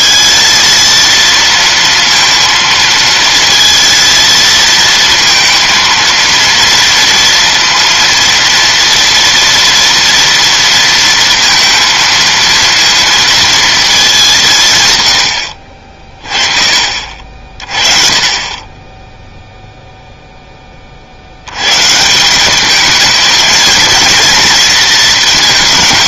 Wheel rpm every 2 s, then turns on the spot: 230, 230, 230, 230, 240, 230, 230, 150, 40, 20, 20, 210, 230.
none